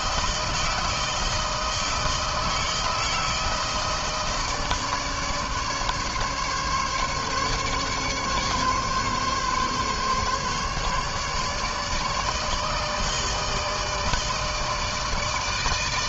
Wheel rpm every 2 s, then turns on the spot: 160, 160, 160, 140, 140, 140, 150, 160.
none